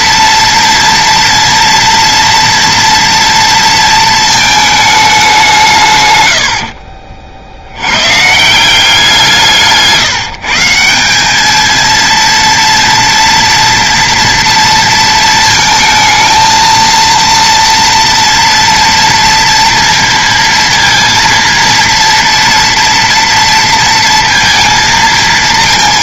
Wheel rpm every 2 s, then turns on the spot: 230, 230, 220, 80, 170, 170, 230, 230, 230, 230, 230, 230, 230.
6-8